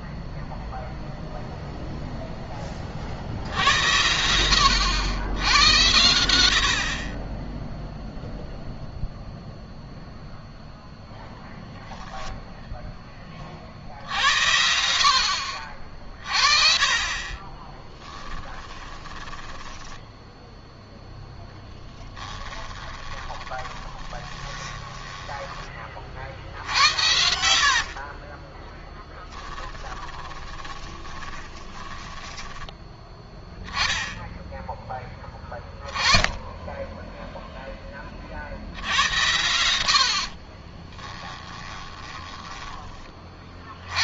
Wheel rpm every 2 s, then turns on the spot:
0, 20, 90, 70, 0, 0, 0, 70, 40, 10, 0, 20, 20, 70, 20, 20, 10, 10, 10, 70, 40, 30.
18-20 22-32 40-42